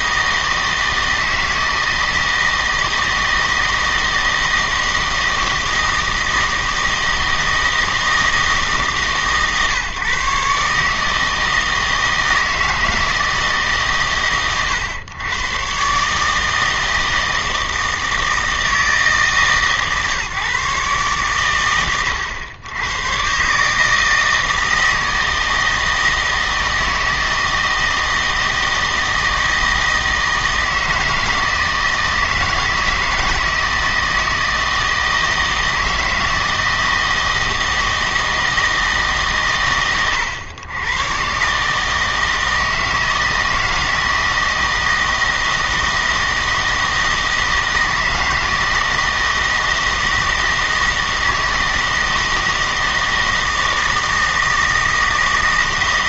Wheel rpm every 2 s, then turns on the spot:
160, 160, 160, 160, 150, 150, 160, 120, 160, 160, 140, 110, 160, 160, 160, 160, 160, 160, 160, 160, 110, 160, 160, 160, 160, 160, 160, 160.
none